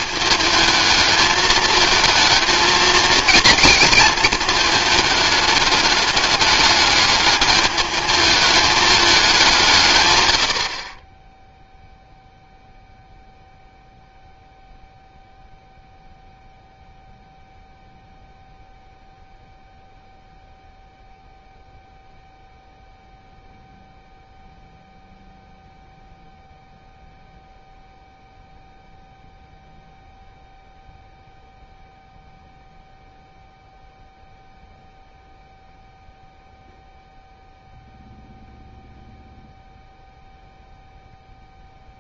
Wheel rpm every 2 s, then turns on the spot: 220, 230, 220, 210, 210, 50, 0, 0, 0, 0, 0, 0, 0, 0, 0, 0, 0, 0, 0, 0, 0.
none